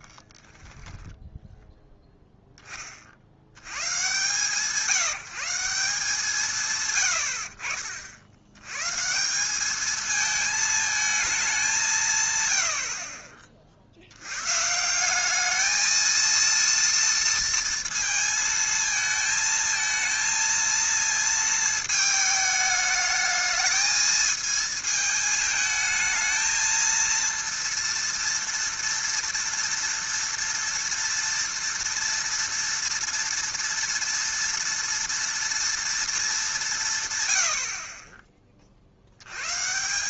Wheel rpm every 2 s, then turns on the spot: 10, 10, 150, 160, 110, 220, 90, 140, 230, 220, 230, 210, 220, 220, 230, 230, 230, 230, 190, 40.
0-2